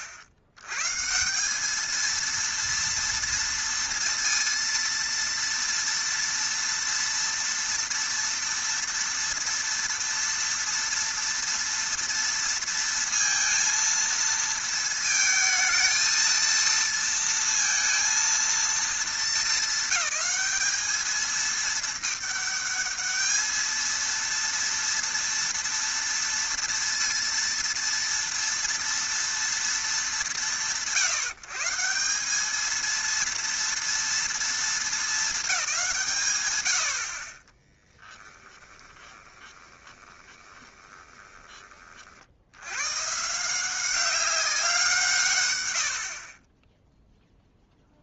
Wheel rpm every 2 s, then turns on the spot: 90, 230, 230, 230, 230, 230, 230, 230, 230, 230, 210, 210, 230, 230, 230, 140, 220, 220, 70, 10, 20, 110, 160, 10.
38-42 46-48